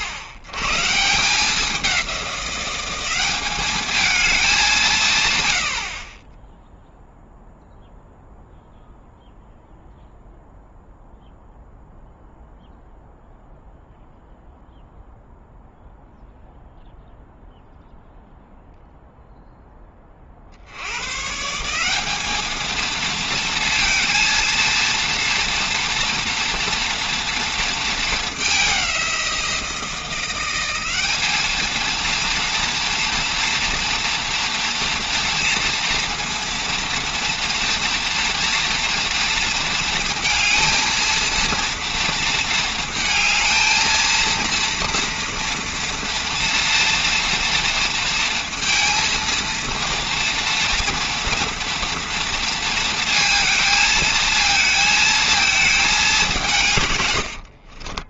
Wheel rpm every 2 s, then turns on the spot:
110, 190, 190, 0, 0, 0, 0, 0, 0, 0, 70, 220, 230, 240, 200, 190, 230, 240, 230, 230, 230, 230, 230, 240, 230, 230, 230, 220, 150.
none